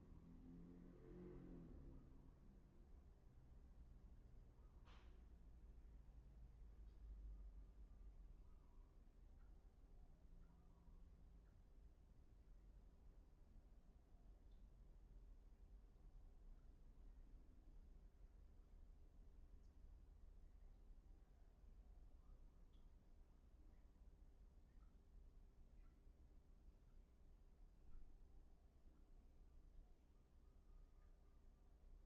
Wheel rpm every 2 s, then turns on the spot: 0, 0, 0, 0, 0, 0, 0, 0, 0, 0, 0, 0, 0, 0, 0, 0.
none